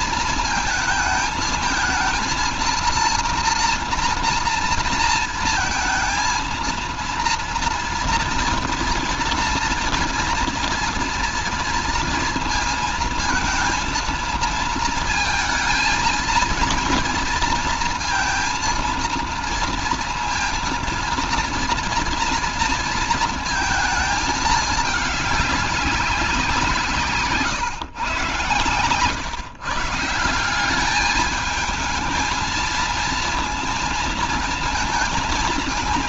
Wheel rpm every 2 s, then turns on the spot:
220, 230, 230, 220, 230, 230, 230, 230, 230, 230, 230, 230, 210, 180, 120, 190, 230, 220.
none